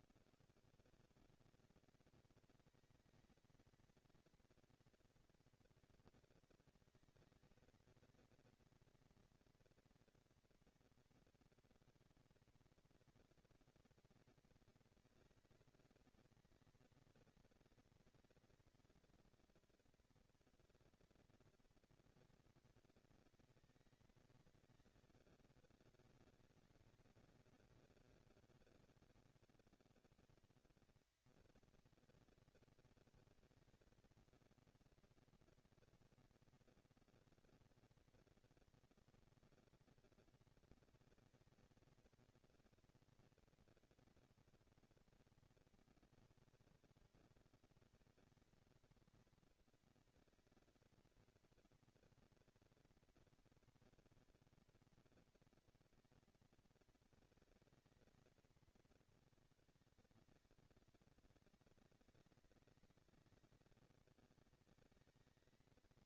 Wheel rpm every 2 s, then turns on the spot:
130, 230, 240, 230, 230, 240, 230, 230, 230, 230, 230, 230, 220, 200, 200, 210, 230, 230, 230, 230, 230, 230, 230, 220, 220, 230, 230, 230, 230, 220, 200, 200, 210.
none